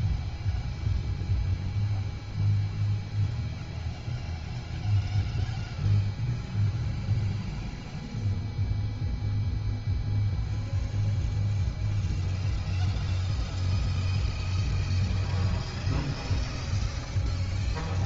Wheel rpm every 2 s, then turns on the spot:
0, 0, 0, 0, 0, 0, 0, 0, 0.
none